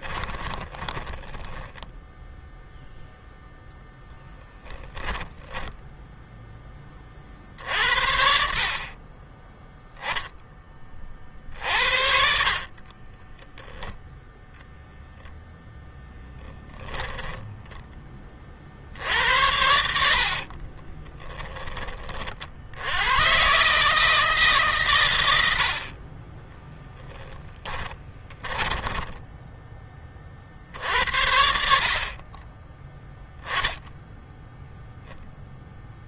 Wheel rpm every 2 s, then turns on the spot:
20, 0, 10, 20, 40, 30, 40, 0, 10, 60, 30, 90, 130, 10, 10, 60, 0, 0.
0-2 4-6 12-14 16-18 20-22 26-30